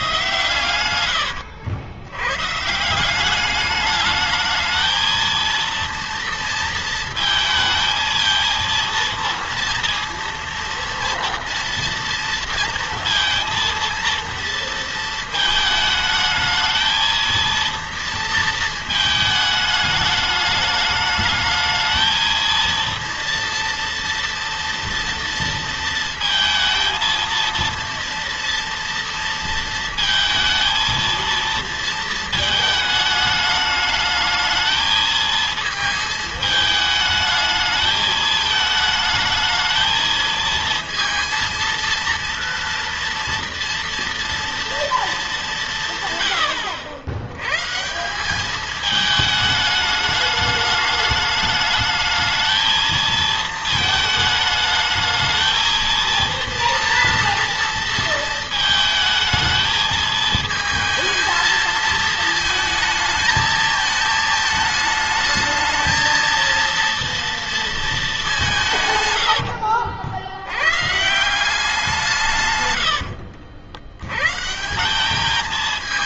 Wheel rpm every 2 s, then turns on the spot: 120, 140, 220, 230, 230, 230, 230, 230, 220, 230, 210, 230, 230, 230, 230, 220, 220, 220, 220, 220, 220, 230, 230, 100, 210, 210, 220, 220, 230, 220, 220, 220, 220, 230, 170, 100, 120, 170.
none